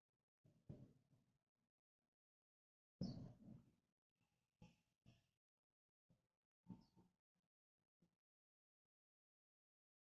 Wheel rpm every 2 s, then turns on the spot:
0, 0, 0, 0, 0.
none